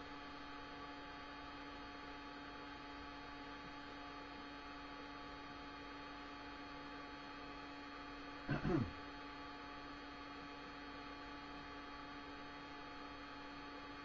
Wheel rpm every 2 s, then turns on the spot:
0, 0, 0, 0, 0, 0, 0.
none